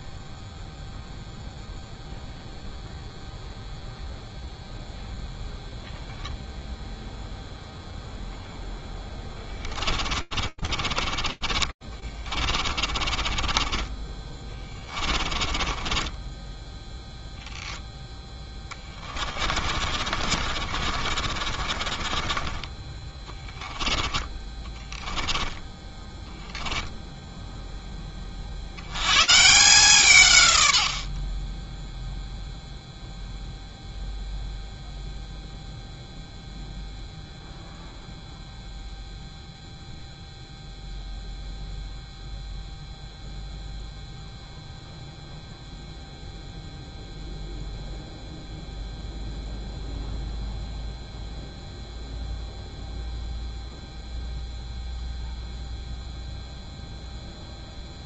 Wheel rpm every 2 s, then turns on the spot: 0, 0, 0, 0, 40, 30, 30, 20, 0, 40, 30, 20, 10, 20, 150, 0, 0, 0, 0, 0, 0, 0, 0, 0, 0, 0, 0, 0, 0.
8-16 18-26